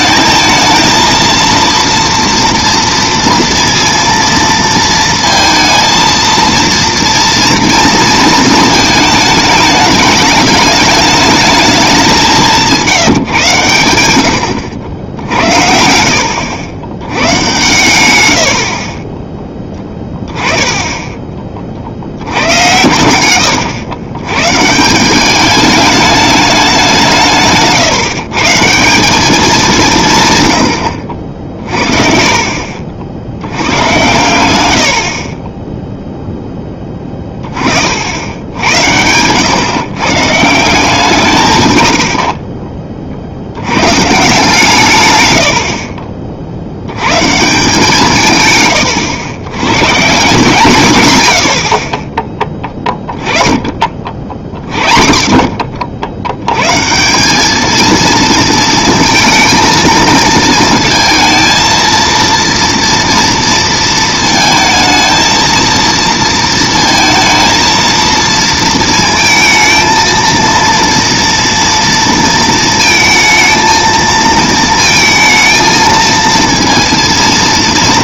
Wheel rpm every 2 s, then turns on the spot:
220, 230, 230, 230, 220, 210, 170, 70, 80, 50, 10, 100, 150, 190, 160, 100, 60, 80, 10, 90, 160, 30, 140, 80, 110, 170, 20, 50, 130, 230, 220, 230, 220, 230, 230, 230, 230, 230, 230.
18-22